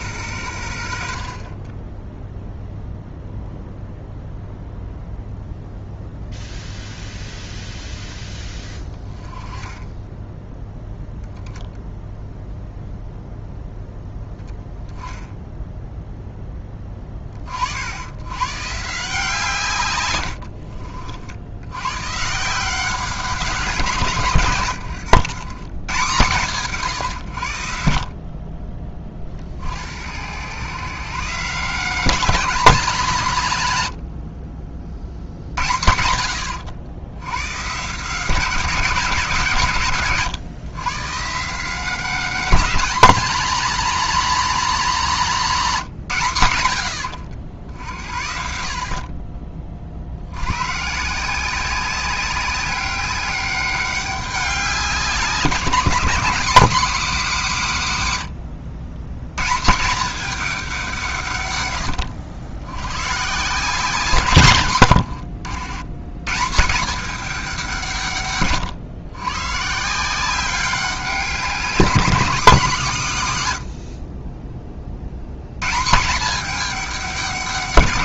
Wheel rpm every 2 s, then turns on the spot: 80, 0, 0, 0, 10, 10, 0, 10, 20, 150, 60, 180, 120, 140, 30, 130, 210, 50, 100, 170, 130, 230, 230, 90, 50, 130, 200, 190, 220, 100, 190, 110, 100, 180, 120, 190, 190, 40, 200.
none